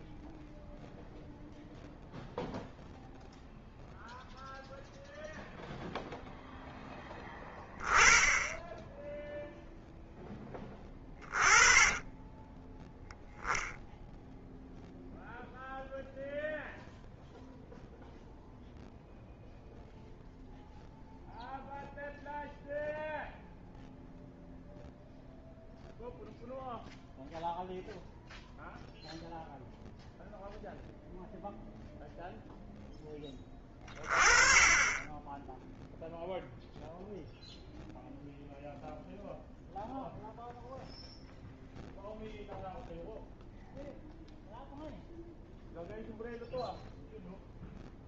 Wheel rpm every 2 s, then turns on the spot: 0, 0, 0, 10, 10, 20, 10, 0, 0, 0, 0, 0, 0, 0, 0, 0, 10, 20, 0, 0, 0, 0, 0, 0.
10-12